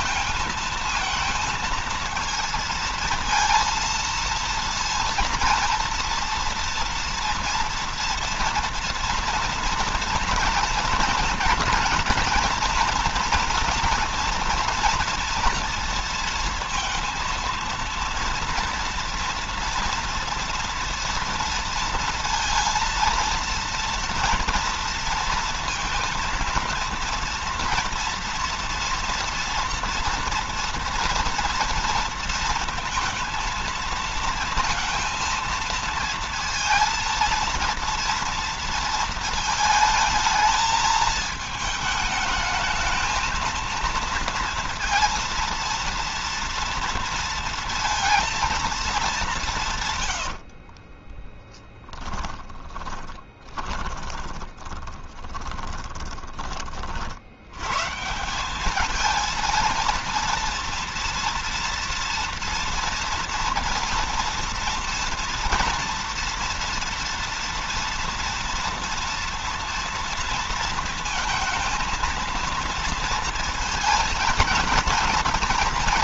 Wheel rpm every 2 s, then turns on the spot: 220, 230, 230, 230, 230, 240, 230, 230, 230, 230, 230, 230, 230, 230, 230, 230, 230, 230, 230, 230, 220, 220, 230, 230, 210, 40, 20, 10, 50, 210, 230, 240, 240, 230, 230, 230, 230, 230.
50-56